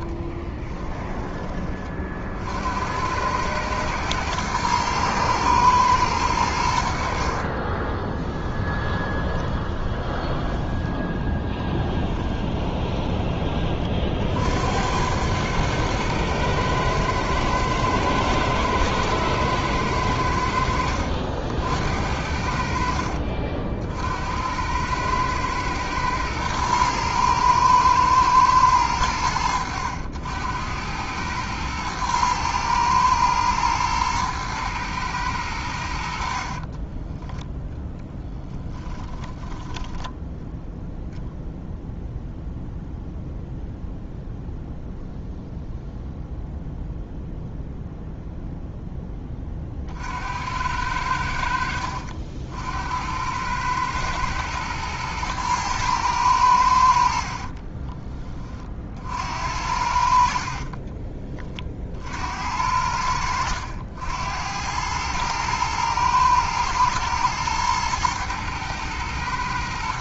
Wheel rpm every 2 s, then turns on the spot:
20, 70, 110, 90, 20, 10, 20, 70, 110, 110, 70, 60, 90, 110, 110, 90, 110, 110, 40, 10, 0, 0, 0, 0, 0, 80, 70, 110, 90, 40, 40, 70, 90, 110, 120.
0-2 8-10 12-14 36-40 60-62